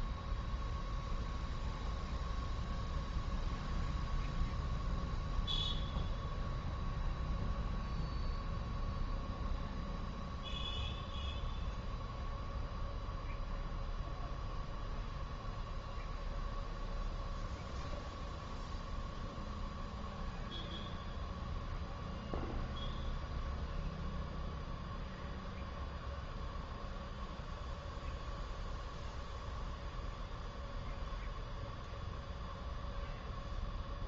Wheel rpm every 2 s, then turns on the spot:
0, 0, 0, 0, 0, 0, 0, 0, 0, 0, 0, 0, 0, 0, 0, 0, 0.
none